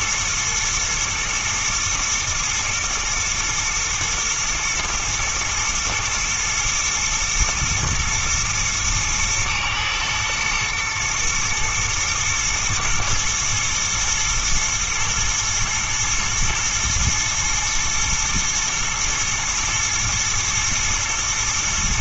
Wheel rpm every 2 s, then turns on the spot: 120, 110, 110, 110, 110, 110, 110, 120, 120, 120, 110.
none